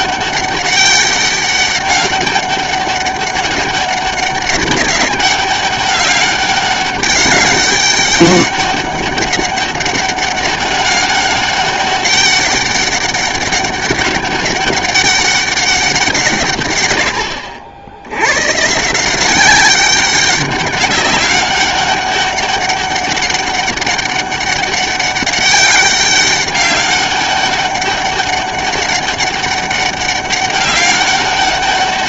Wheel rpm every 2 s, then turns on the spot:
200, 200, 200, 200, 200, 200, 200, 200, 120, 150, 200, 200, 200, 200, 200, 200.
none